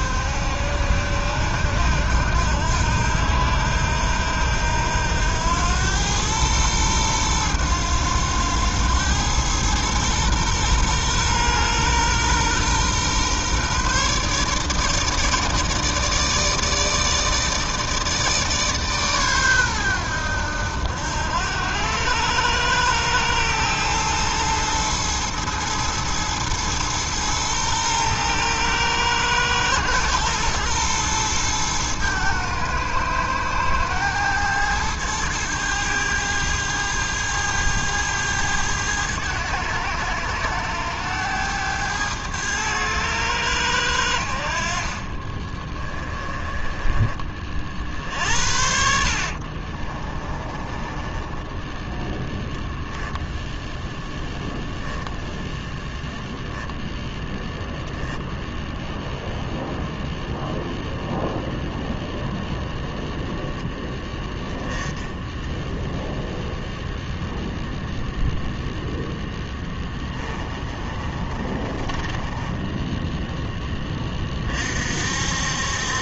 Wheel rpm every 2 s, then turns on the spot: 70, 80, 80, 110, 100, 120, 130, 150, 150, 140, 80, 110, 110, 110, 110, 110, 110, 110, 110, 100, 100, 100, 50, 20, 70, 20, 10, 0, 10, 0, 0, 0, 10, 0, 0, 30, 10, 50.
44-52 70-74